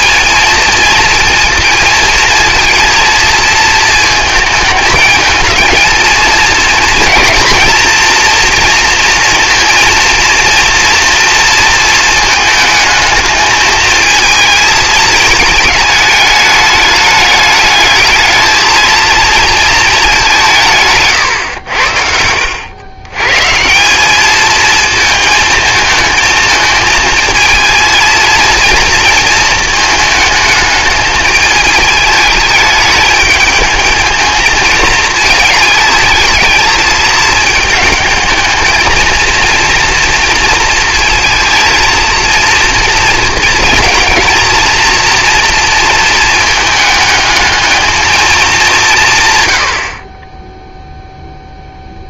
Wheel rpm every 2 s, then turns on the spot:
230, 230, 220, 220, 230, 230, 220, 220, 210, 220, 170, 90, 220, 220, 220, 220, 210, 220, 220, 220, 230, 230, 230, 220, 190, 0.
none